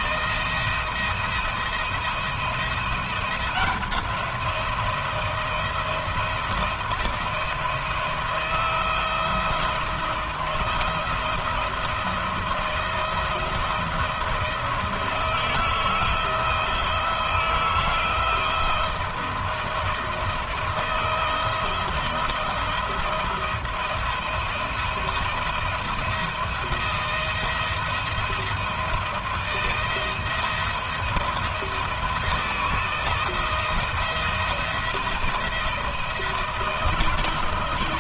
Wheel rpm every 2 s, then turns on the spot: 170, 170, 170, 170, 170, 170, 170, 160, 170, 170, 160, 170, 170, 170, 170, 170, 160, 170, 170.
none